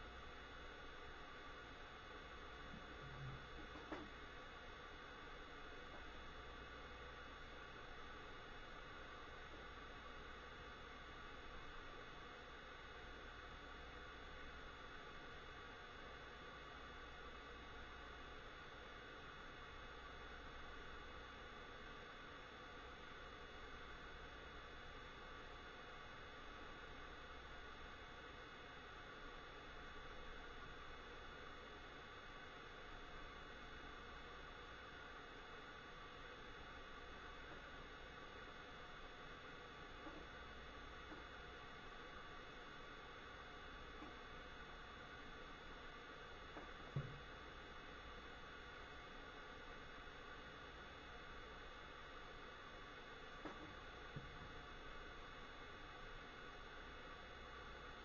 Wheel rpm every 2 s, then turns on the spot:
0, 0, 0, 0, 0, 0, 0, 0, 0, 0, 0, 0, 0, 0, 0, 0, 0, 0, 0, 0, 0, 0, 0, 0, 0, 0, 0, 0, 0.
none